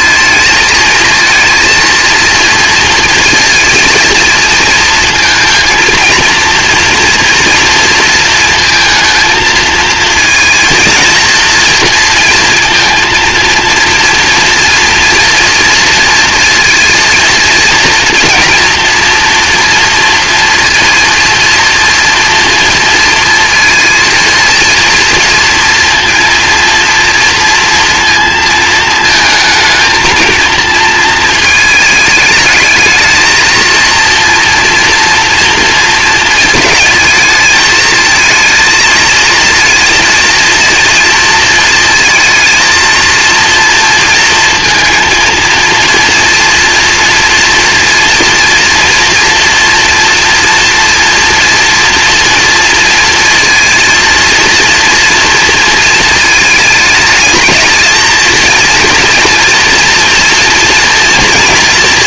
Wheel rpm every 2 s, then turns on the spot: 220, 230, 230, 230, 220, 230, 230, 230, 230, 230, 230, 230, 230, 230, 220, 220, 220, 230, 220, 220, 230, 230, 230, 230, 230, 230, 230, 230, 220, 230, 230.
none